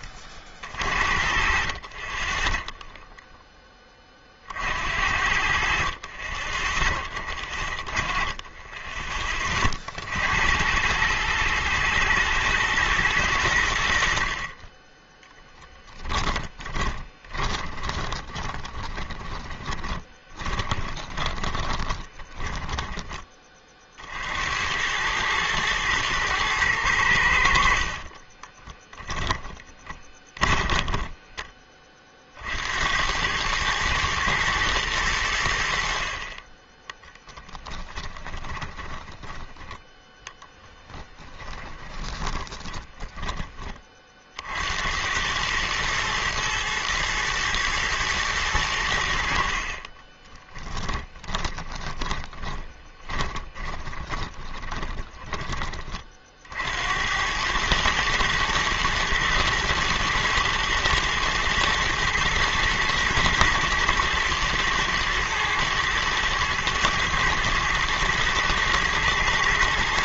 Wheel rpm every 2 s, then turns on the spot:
50, 10, 60, 20, 20, 110, 110, 20, 20, 20, 20, 10, 100, 90, 10, 20, 90, 100, 10, 20, 20, 10, 90, 110, 80, 10, 20, 10, 80, 110, 110, 110, 110, 110, 120.
2-4 16-22 28-32 36-42 50-56